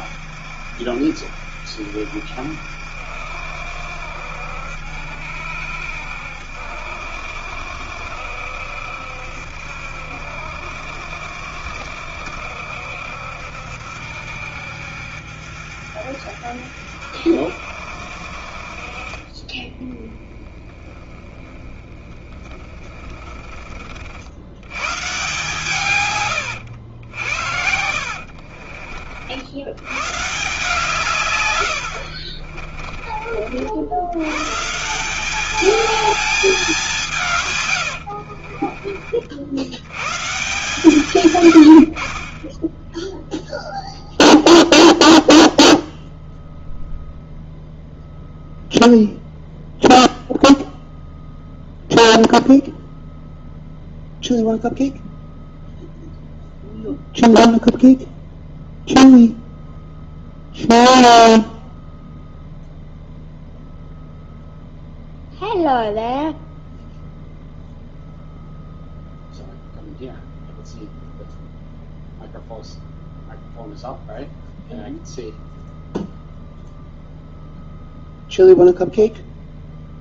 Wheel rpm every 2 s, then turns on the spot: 70, 70, 70, 70, 70, 70, 70, 70, 70, 40, 10, 30, 120, 90, 50, 140, 40, 170, 190, 50, 150, 10, 0, 0, 0, 0, 0, 0, 0, 0, 0, 0, 0, 0, 0, 0, 0, 0, 0, 0.
18-24 32-34